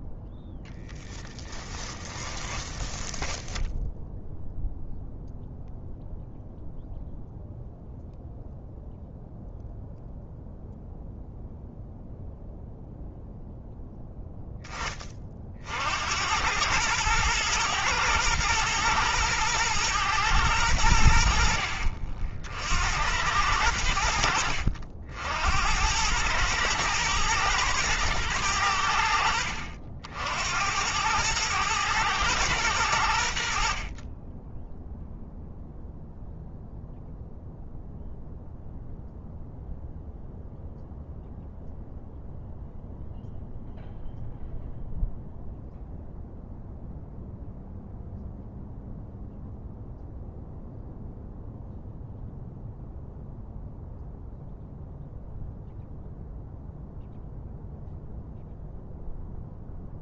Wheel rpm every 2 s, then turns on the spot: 10, 10, 0, 0, 0, 0, 0, 20, 100, 110, 80, 80, 80, 110, 90, 90, 90, 0, 0, 0, 0, 0, 0, 0, 0, 0, 0, 0, 0, 0.
0-4